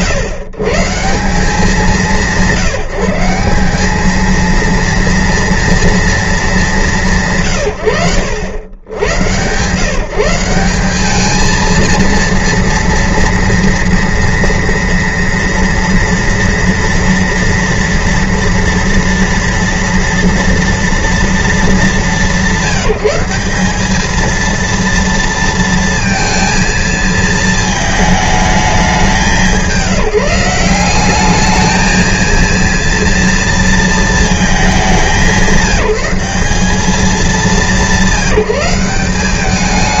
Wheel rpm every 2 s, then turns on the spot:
130, 160, 230, 200, 90, 190, 230, 230, 230, 230, 230, 170, 230, 230, 200, 170, 230, 200, 200, 190.
none